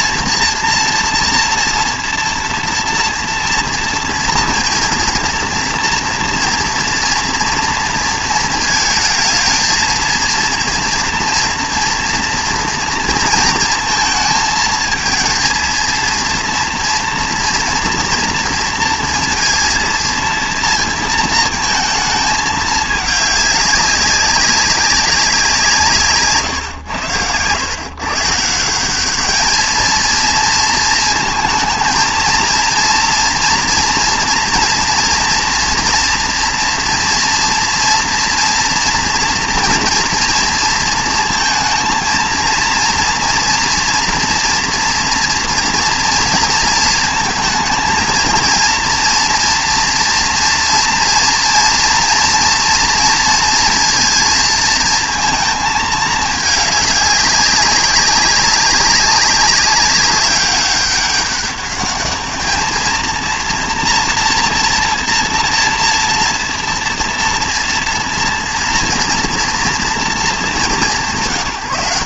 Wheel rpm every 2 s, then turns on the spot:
230, 230, 230, 240, 220, 230, 230, 220, 230, 230, 230, 220, 190, 130, 170, 220, 230, 240, 230, 230, 230, 230, 230, 230, 230, 230, 240, 230, 210, 190, 190, 220, 230, 230, 230, 210.
none